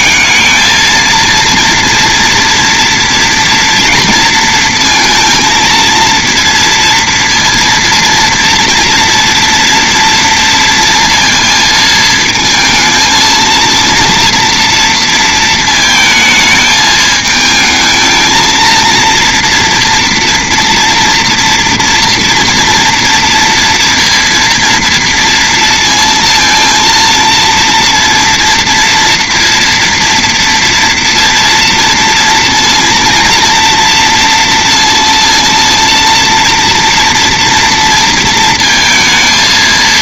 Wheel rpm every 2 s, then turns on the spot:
220, 240, 230, 230, 230, 230, 220, 230, 220, 230, 230, 230, 230, 230, 230, 230, 230, 230, 230, 230.
none